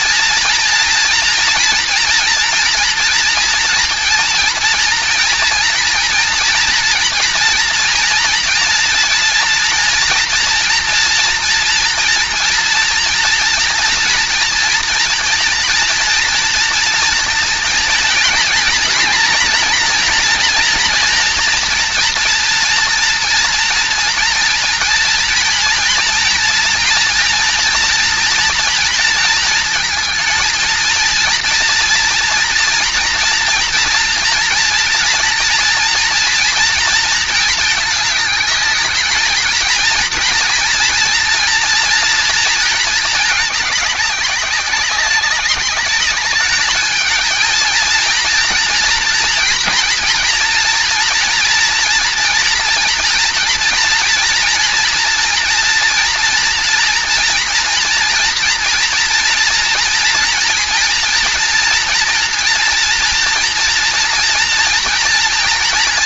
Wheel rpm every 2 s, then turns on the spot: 240, 230, 230, 230, 230, 230, 230, 240, 230, 240, 230, 240, 230, 230, 220, 230, 230, 230, 220, 220, 230, 220, 200, 220, 240, 230, 240, 230, 230, 230, 230, 230, 230.
none